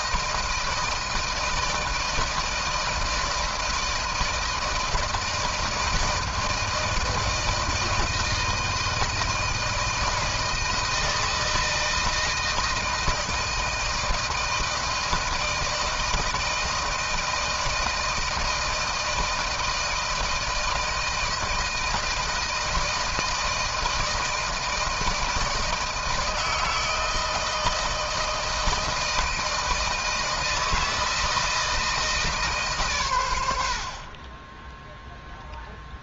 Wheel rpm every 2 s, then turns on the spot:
160, 160, 160, 160, 160, 160, 160, 160, 160, 160, 160, 160, 160, 160, 160, 160, 150, 10.
none